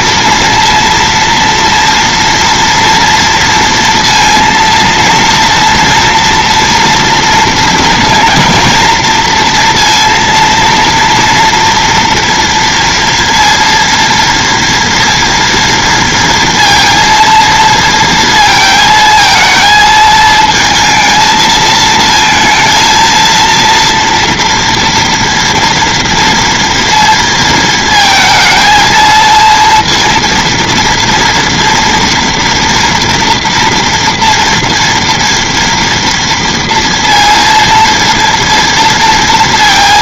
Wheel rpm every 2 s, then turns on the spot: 230, 230, 230, 230, 230, 230, 230, 230, 230, 220, 230, 230, 230, 230, 220, 230, 230, 240, 230, 230.
none